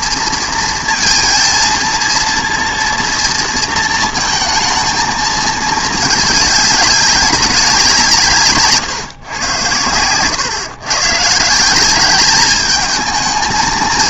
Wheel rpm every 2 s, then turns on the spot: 230, 230, 220, 200, 130, 130, 220.
none